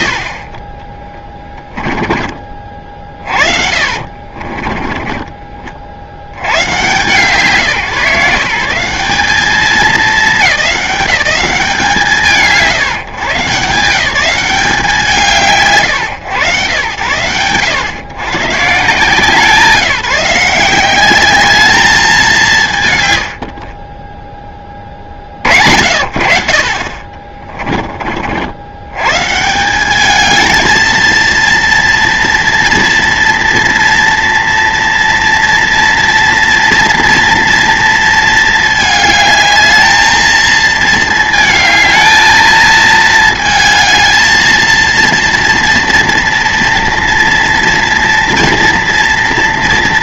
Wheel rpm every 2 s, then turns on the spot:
60, 30, 30, 150, 140, 210, 150, 170, 110, 140, 170, 170, 10, 40, 90, 220, 230, 230, 230, 220, 220, 220, 230, 230, 230.
4-6